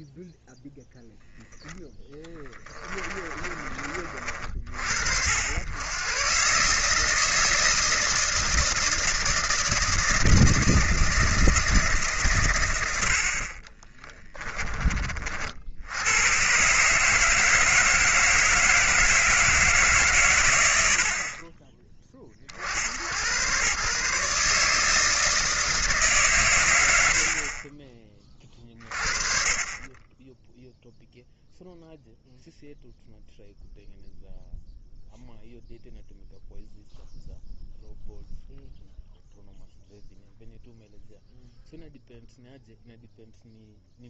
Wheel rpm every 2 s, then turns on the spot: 0, 30, 60, 150, 160, 160, 100, 30, 140, 160, 90, 60, 150, 90, 40, 0, 0, 0, 0, 0, 0, 0.
2-4 14-16